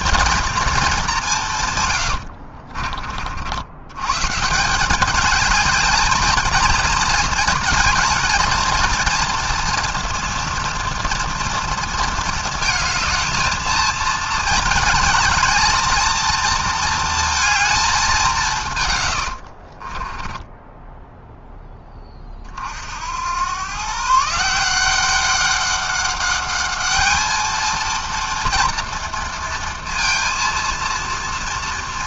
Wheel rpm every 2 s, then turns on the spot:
180, 60, 210, 220, 230, 230, 220, 220, 230, 80, 10, 90, 190, 220, 230, 230.
18-20